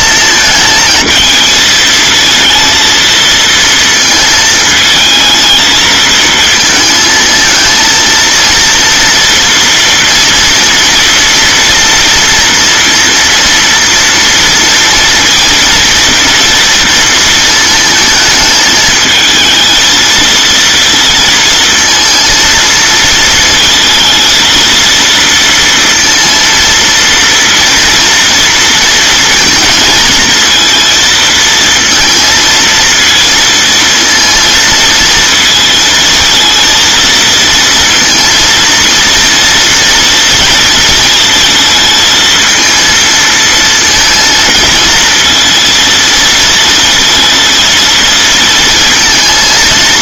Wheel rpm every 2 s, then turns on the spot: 230, 220, 220, 230, 230, 230, 230, 230, 230, 220, 230, 230, 230, 230, 230, 230, 230, 220, 230, 230, 230, 220, 220, 230, 230.
none